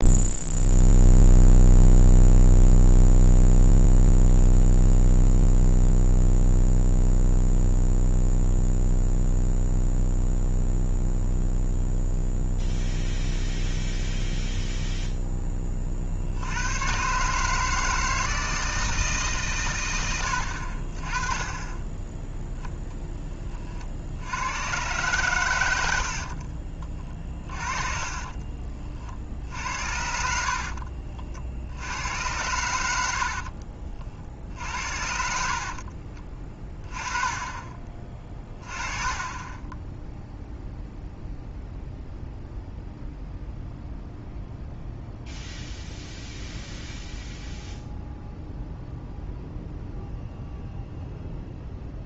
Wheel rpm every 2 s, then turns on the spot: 0, 0, 0, 0, 0, 0, 0, 0, 80, 160, 70, 10, 110, 40, 30, 50, 80, 60, 30, 20, 0, 0, 0, 0, 0, 0.
26-28 30-32 38-40